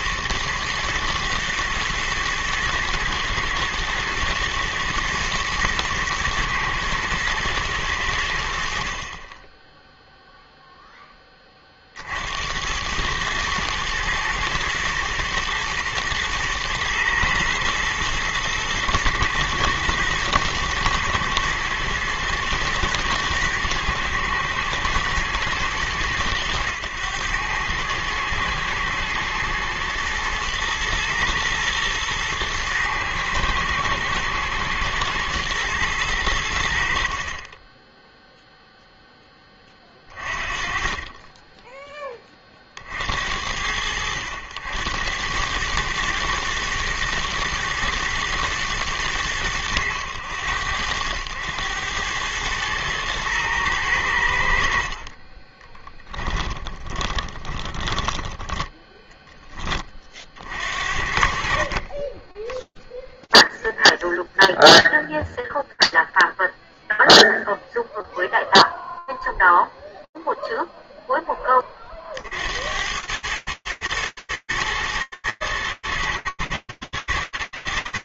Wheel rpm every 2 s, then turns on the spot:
110, 110, 120, 120, 70, 0, 80, 120, 110, 120, 110, 110, 110, 100, 110, 120, 110, 110, 70, 0, 30, 20, 80, 110, 110, 90, 110, 70, 20, 10, 60, 10, 0, 0, 0, 0, 90, 110, 110.
56-60